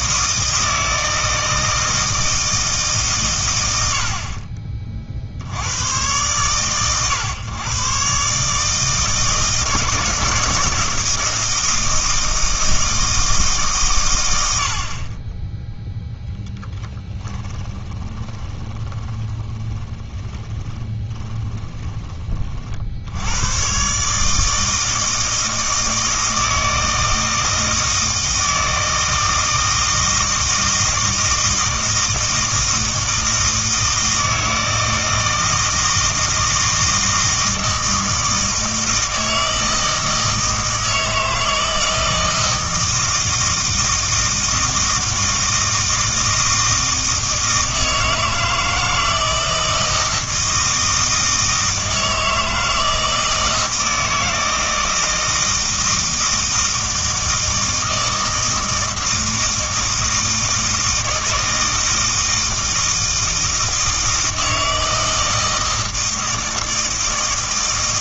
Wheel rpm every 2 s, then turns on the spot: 160, 150, 40, 120, 150, 160, 160, 60, 10, 10, 30, 50, 160, 160, 160, 160, 160, 160, 160, 160, 160, 160, 160, 160, 160, 160, 160, 160, 160, 160, 160, 160, 160, 160.
16-22